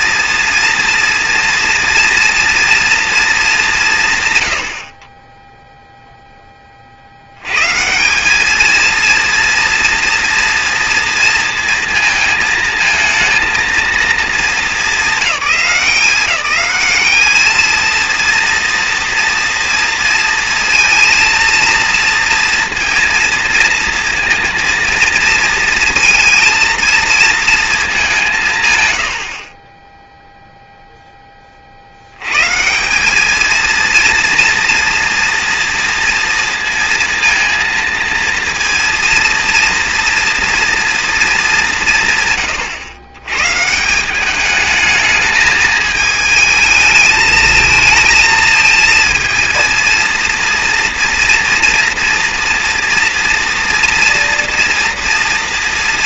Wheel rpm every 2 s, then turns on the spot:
240, 230, 100, 40, 220, 230, 220, 210, 200, 230, 230, 230, 230, 230, 110, 0, 170, 230, 230, 230, 230, 120, 220, 220, 220, 230, 230, 230.
none